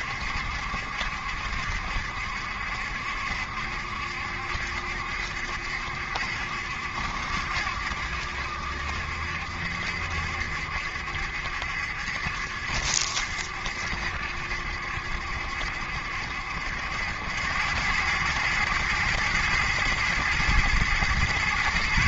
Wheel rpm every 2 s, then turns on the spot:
70, 70, 70, 70, 70, 70, 70, 70, 80, 110, 120.
none